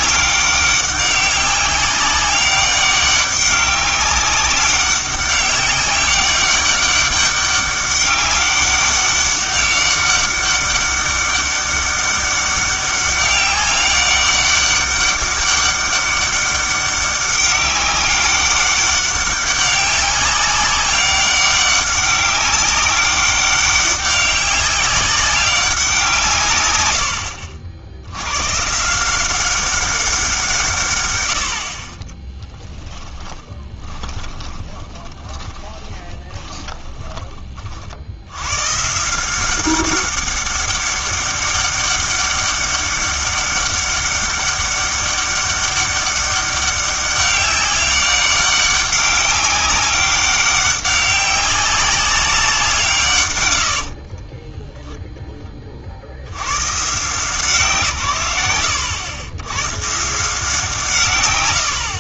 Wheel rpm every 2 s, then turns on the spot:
200, 200, 200, 200, 200, 200, 200, 200, 200, 200, 200, 200, 190, 120, 140, 140, 10, 30, 20, 120, 200, 200, 200, 200, 200, 200, 170, 10, 120, 100, 150.
32-38 54-56